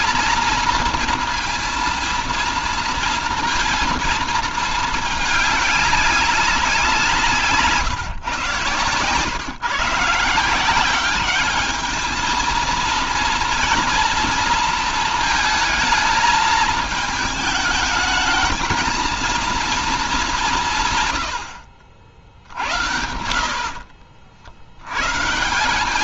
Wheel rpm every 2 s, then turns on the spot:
230, 230, 220, 190, 120, 190, 230, 230, 220, 230, 160, 70, 90.
20-24